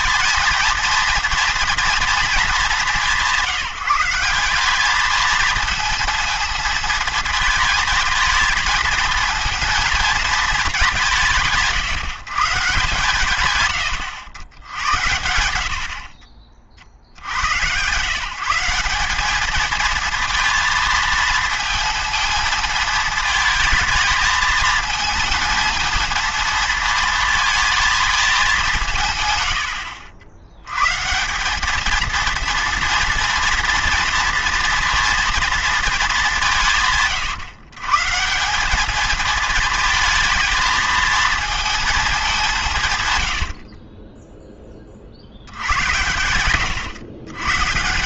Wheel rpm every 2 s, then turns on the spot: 230, 210, 200, 220, 220, 210, 150, 90, 50, 180, 230, 230, 220, 230, 180, 110, 220, 230, 160, 200, 220, 160, 10, 110.
none